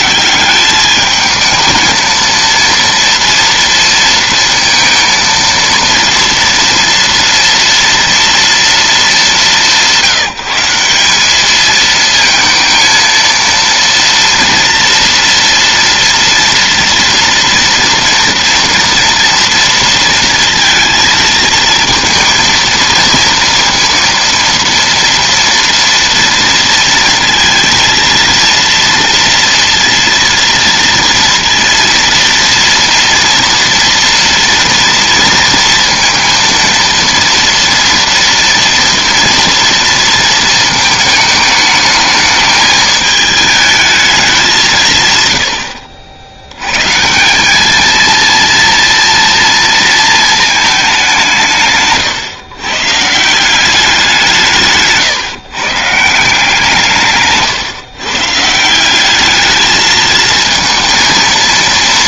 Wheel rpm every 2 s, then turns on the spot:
180, 230, 230, 230, 230, 170, 220, 230, 230, 230, 230, 220, 230, 230, 230, 230, 230, 230, 230, 230, 230, 210, 200, 80, 230, 220, 130, 170, 160, 150, 220.
none